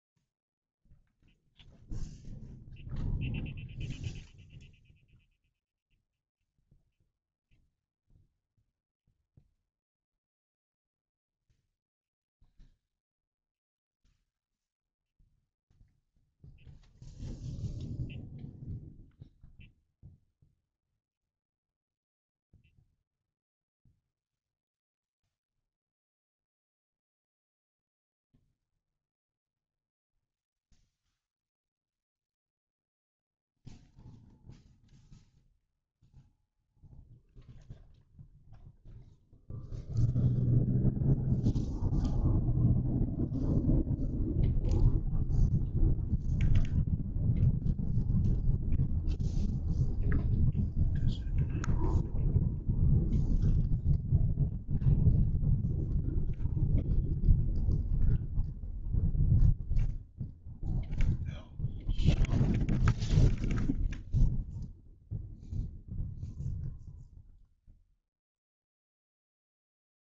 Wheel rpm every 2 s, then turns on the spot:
0, 0, 0, 0, 0, 0, 0, 0, 0, 0, 0, 0, 0, 0, 0, 0, 0, 0, 0, 0, 0, 0, 0, 0, 0, 0, 0, 0, 0, 0, 0, 0, 0, 0, 0.
none